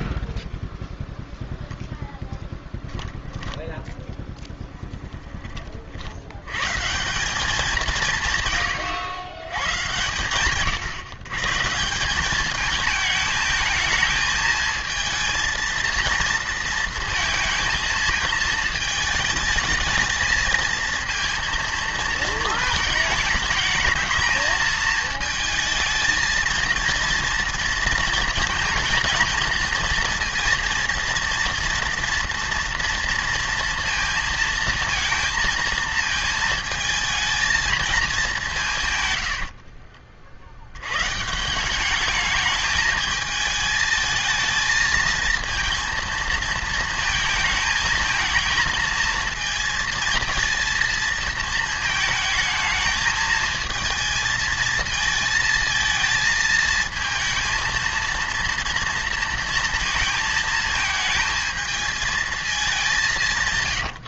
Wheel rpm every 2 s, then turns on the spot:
0, 10, 10, 130, 120, 130, 210, 220, 230, 220, 230, 220, 220, 230, 220, 230, 230, 230, 220, 160, 80, 210, 220, 230, 230, 230, 220, 230, 220, 230, 220, 200.
2-4